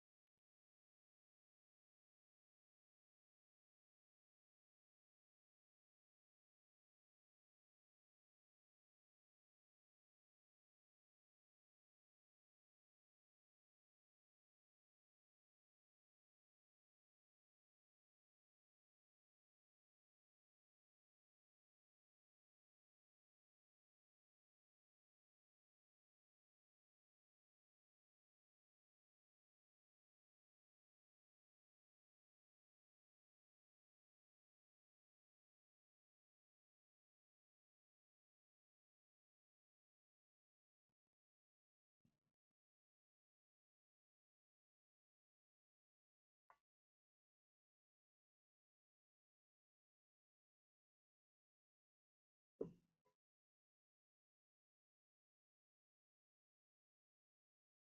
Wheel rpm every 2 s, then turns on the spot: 0, 0, 0, 0, 0, 0, 0, 0, 0, 0, 0, 0, 0, 0, 0, 0, 0, 0, 0, 0, 0, 0, 0, 0, 0, 0, 0, 0, 0.
none